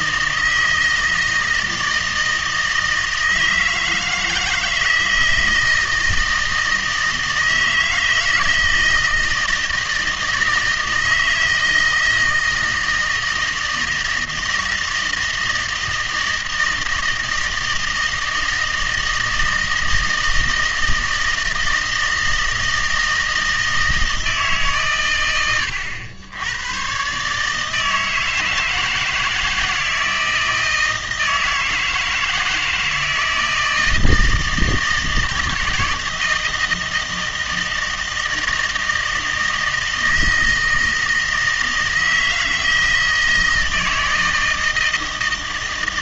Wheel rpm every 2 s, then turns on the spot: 160, 160, 160, 160, 160, 160, 160, 160, 160, 160, 160, 160, 130, 110, 160, 160, 160, 160, 160, 160, 160, 160, 160.
none